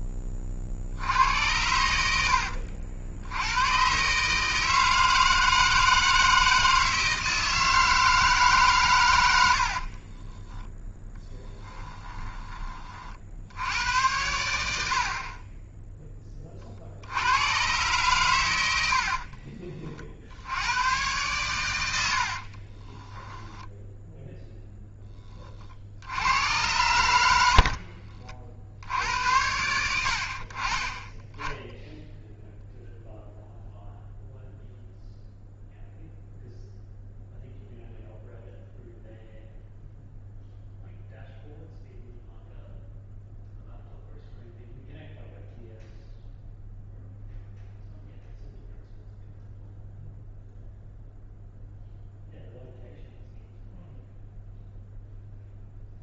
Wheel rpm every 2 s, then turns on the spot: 60, 70, 160, 160, 140, 10, 20, 80, 50, 100, 100, 30, 0, 110, 60, 30, 0, 0, 0, 0, 0, 0, 0, 0, 0, 0, 0, 0.
10-12 22-24